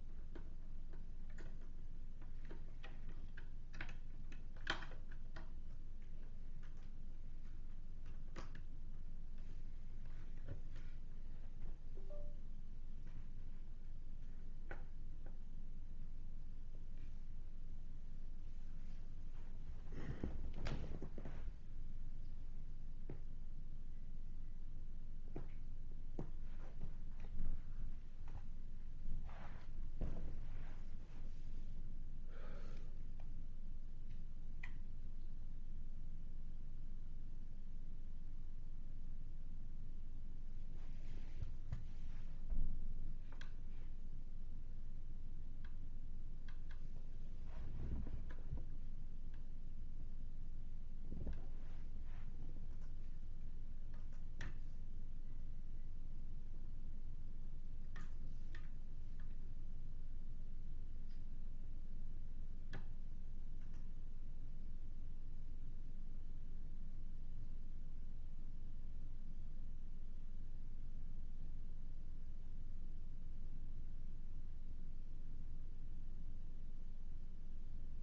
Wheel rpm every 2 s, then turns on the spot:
0, 0, 0, 0, 0, 0, 0, 0, 0, 0, 0, 0, 0, 0, 0, 0, 0, 0, 0, 0, 0, 0, 0, 0, 0, 0, 0, 0, 0, 0, 0, 0, 0, 0, 0, 0, 0, 0, 0.
none